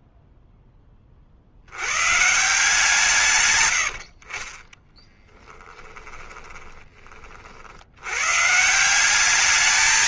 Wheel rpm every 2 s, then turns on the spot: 40, 150, 10, 40, 190.
4-6